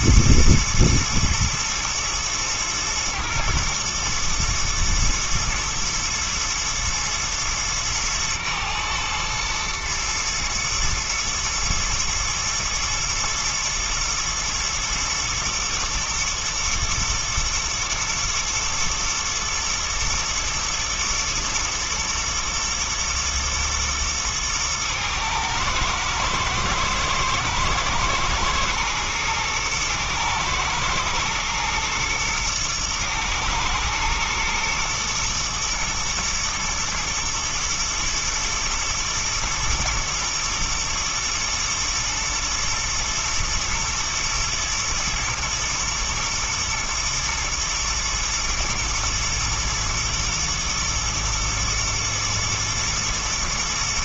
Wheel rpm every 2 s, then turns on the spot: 110, 110, 120, 110, 110, 110, 120, 110, 120, 110, 120, 120, 110, 120, 120, 110, 120, 120, 120, 120, 120, 110, 120, 110, 110, 110, 110.
none